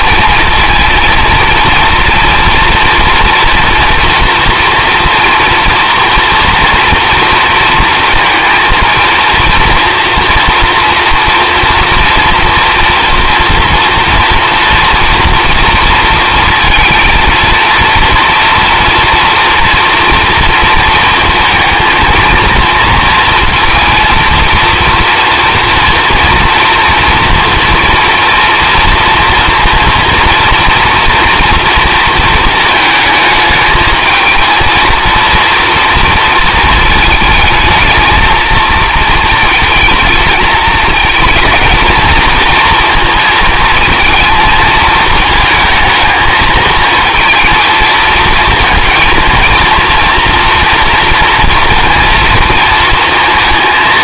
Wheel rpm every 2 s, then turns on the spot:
230, 230, 230, 230, 230, 230, 230, 230, 230, 230, 230, 230, 230, 230, 230, 230, 220, 230, 220, 220, 220, 230, 220, 220, 230, 230, 230.
none